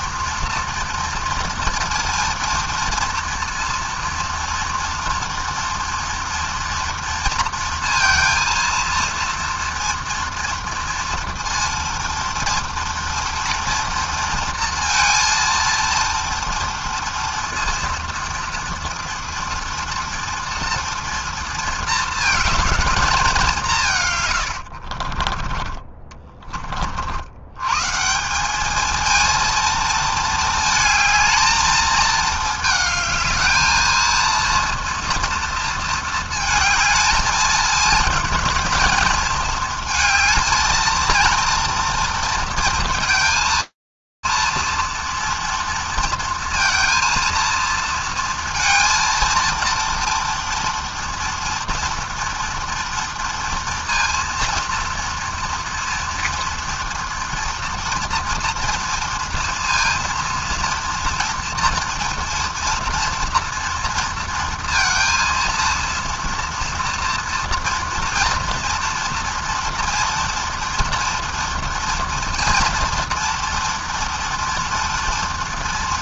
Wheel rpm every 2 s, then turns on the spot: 230, 230, 230, 230, 230, 230, 230, 230, 230, 230, 230, 190, 30, 110, 230, 220, 220, 230, 220, 230, 230, 230, 230, 230, 230, 230, 230, 230, 230, 230, 230, 240, 230, 230, 240, 230, 240, 230.
24-26